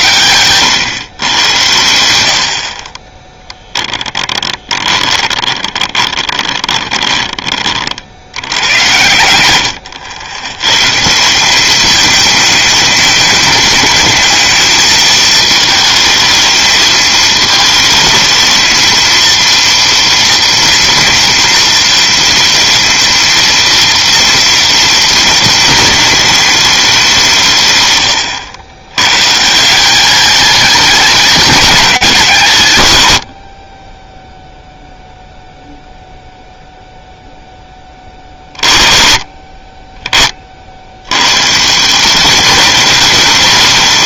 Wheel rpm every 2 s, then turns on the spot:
110, 50, 20, 20, 100, 120, 210, 220, 220, 220, 230, 230, 230, 210, 110, 210, 120, 0, 0, 20, 60, 200.
4-8